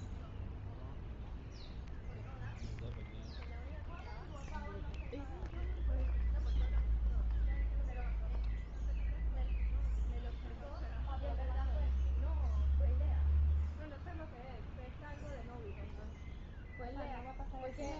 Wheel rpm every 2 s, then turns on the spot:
0, 0, 0, 0, 0, 0, 0, 0, 0.
none